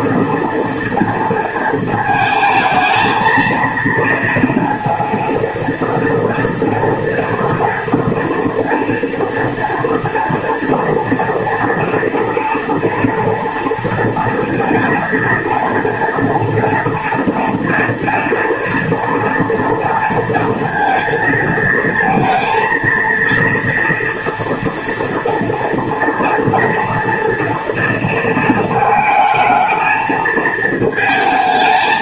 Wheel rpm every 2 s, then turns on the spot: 230, 220, 230, 230, 230, 230, 230, 230, 230, 230, 230, 230, 230, 240, 220, 220.
none